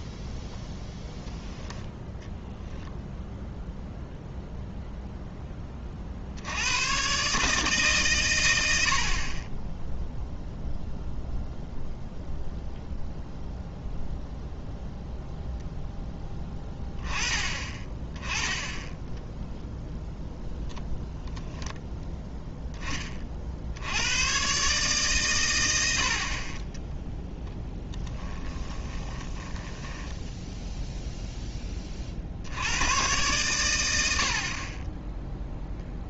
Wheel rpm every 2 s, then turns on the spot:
0, 0, 0, 80, 110, 0, 0, 0, 10, 10, 0, 10, 130, 30, 10, 10, 70, 50.
26-30